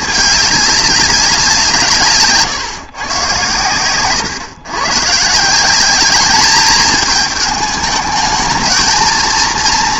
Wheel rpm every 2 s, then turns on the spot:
200, 130, 130, 210, 220.
none